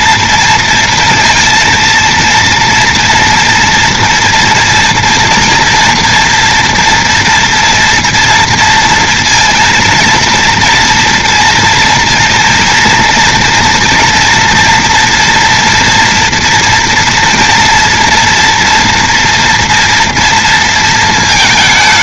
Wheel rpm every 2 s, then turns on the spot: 230, 230, 230, 230, 230, 230, 240, 240, 240, 230, 230.
none